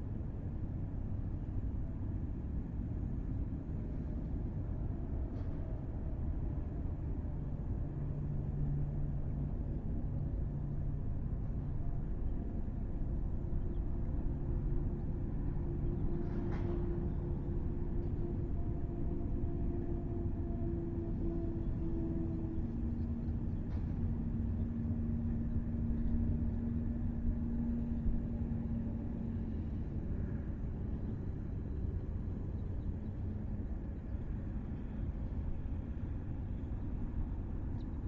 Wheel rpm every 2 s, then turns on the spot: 0, 0, 0, 0, 0, 0, 0, 0, 0, 0, 0, 0, 0, 0, 0, 0, 0, 0, 0.
none